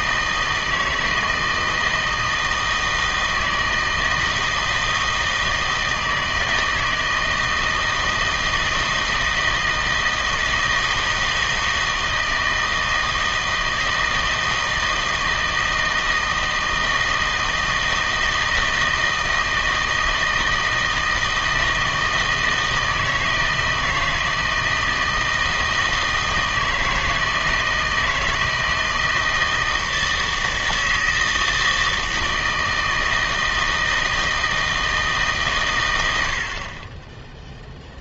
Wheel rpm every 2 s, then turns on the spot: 160, 160, 160, 160, 160, 160, 160, 160, 160, 160, 160, 160, 160, 160, 160, 160, 160, 160, 40.
none